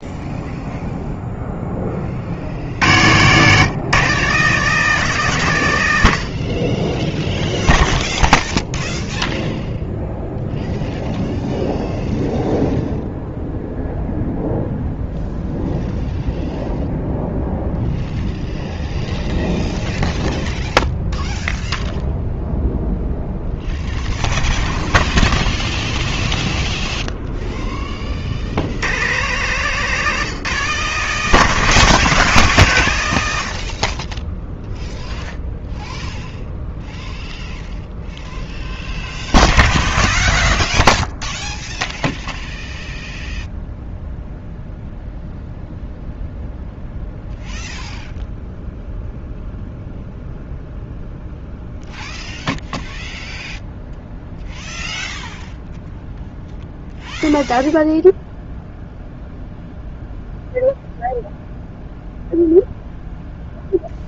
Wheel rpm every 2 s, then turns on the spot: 0, 80, 170, 20, 0, 0, 0, 0, 0, 0, 0, 0, 0, 0, 120, 170, 130, 0, 0, 0, 0, 0, 0, 0, 0, 0, 0, 0, 0, 0, 0, 0.
none